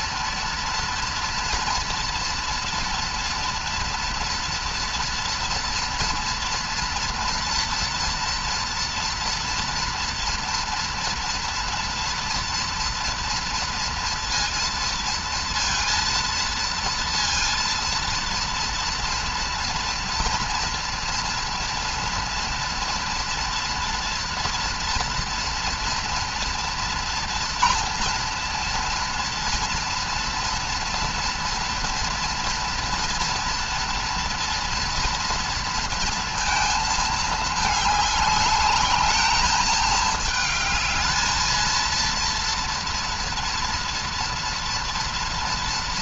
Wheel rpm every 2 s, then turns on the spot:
230, 230, 230, 240, 230, 230, 230, 230, 230, 230, 230, 240, 240, 230, 230, 230, 230, 240, 220, 210, 220, 240, 230.
none